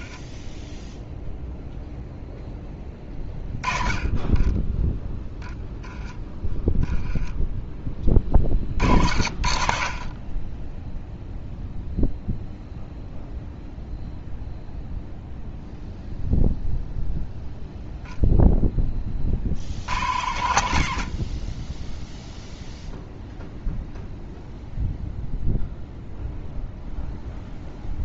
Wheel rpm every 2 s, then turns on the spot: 0, 10, 10, 10, 60, 0, 0, 0, 0, 20, 90, 0, 0, 0.
4-6